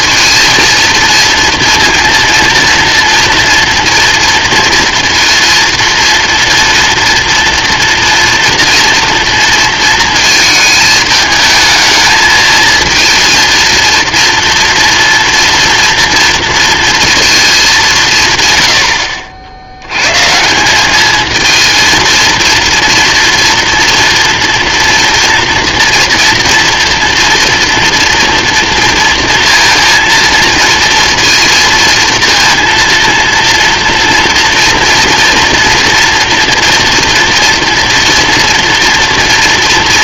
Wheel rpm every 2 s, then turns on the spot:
230, 230, 230, 230, 230, 220, 220, 230, 230, 130, 170, 230, 240, 240, 230, 230, 230, 230, 230, 240.
none